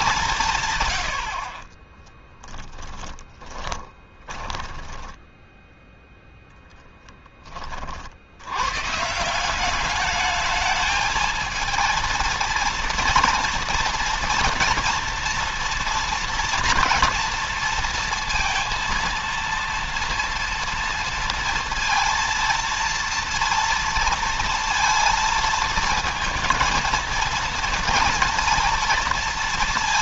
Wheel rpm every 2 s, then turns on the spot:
110, 20, 10, 10, 140, 220, 230, 230, 230, 230, 230, 230, 230, 230, 230.
2-6